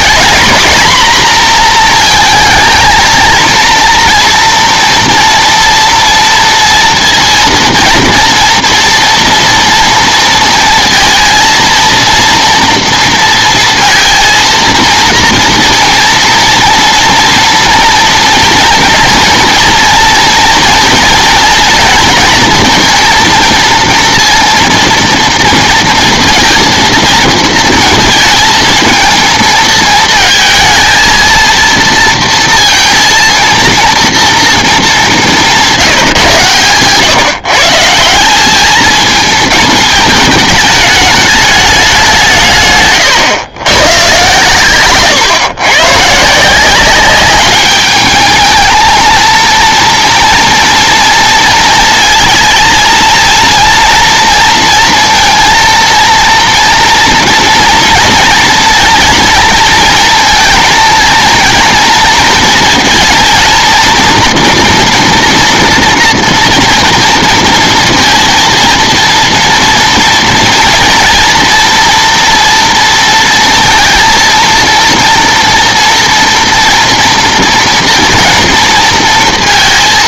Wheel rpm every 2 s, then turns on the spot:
240, 220, 230, 230, 240, 230, 230, 230, 230, 230, 230, 230, 230, 230, 230, 220, 230, 220, 130, 200, 210, 150, 130, 180, 220, 230, 230, 230, 230, 230, 220, 230, 240, 240, 230, 230, 230, 230, 230, 230.
none